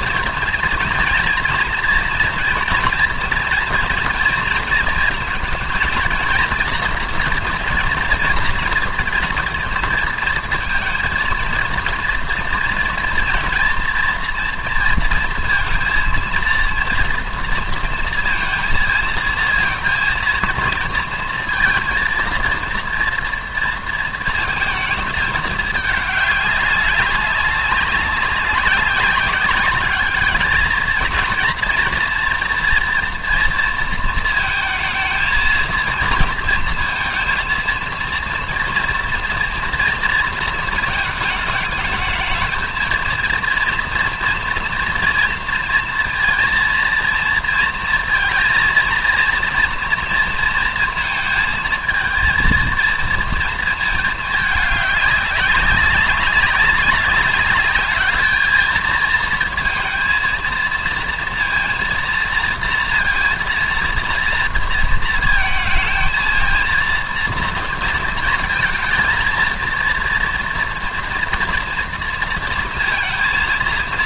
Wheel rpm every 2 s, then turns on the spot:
230, 230, 230, 230, 240, 230, 230, 230, 230, 230, 230, 240, 220, 200, 190, 230, 230, 230, 230, 230, 220, 220, 230, 230, 230, 230, 230, 200, 190, 220, 230, 230, 230, 230, 220, 230, 230.
none